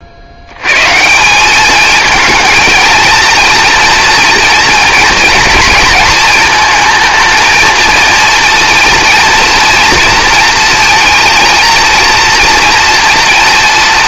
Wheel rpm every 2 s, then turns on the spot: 110, 230, 230, 230, 230, 230, 230.
none